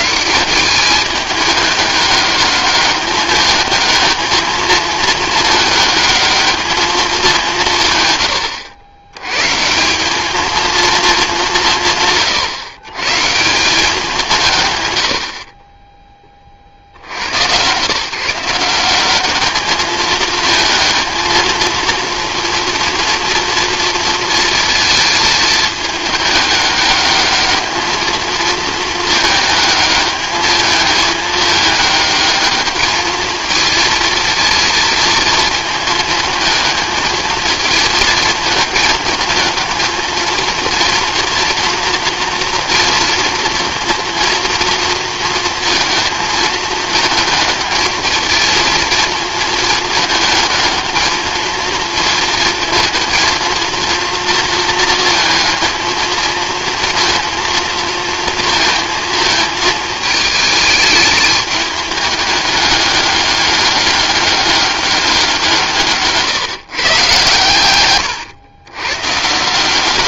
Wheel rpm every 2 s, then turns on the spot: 200, 210, 220, 220, 100, 230, 130, 160, 40, 170, 220, 230, 230, 210, 220, 220, 220, 230, 220, 210, 220, 230, 230, 220, 230, 220, 220, 230, 230, 220, 210, 200, 200, 140, 110.
none